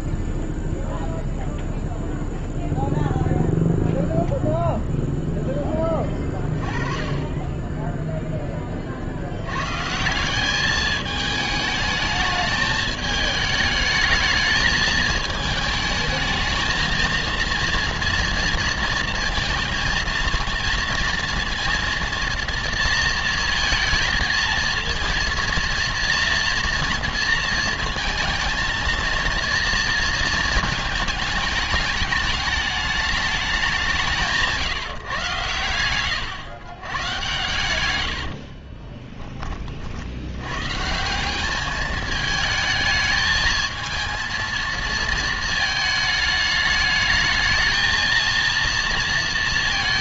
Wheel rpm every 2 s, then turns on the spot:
0, 0, 0, 20, 20, 200, 220, 210, 220, 230, 230, 230, 220, 230, 230, 220, 220, 160, 120, 50, 110, 220, 230, 210, 230.
38-40